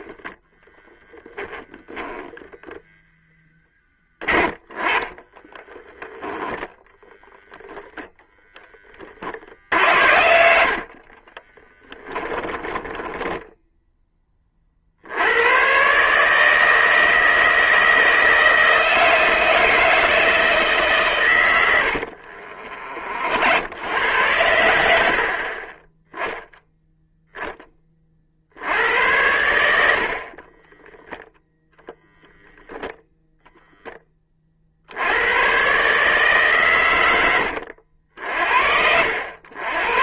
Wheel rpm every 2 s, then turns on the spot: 10, 0, 20, 0, 10, 60, 10, 40, 160, 160, 150, 50, 100, 0, 70, 30, 0, 60, 130, 60.
0-2 4-6 10-14 22-24 30-32